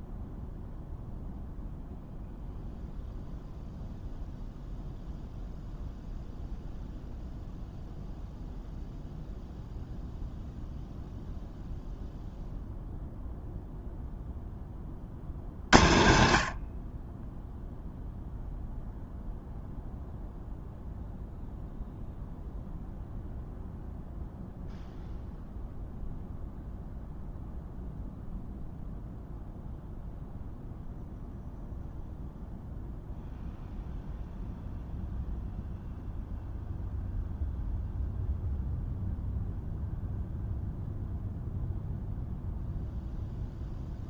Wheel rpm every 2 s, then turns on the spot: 0, 0, 0, 0, 0, 0, 0, 40, 30, 0, 0, 0, 0, 0, 0, 0, 0, 0, 0, 0, 0, 0.
none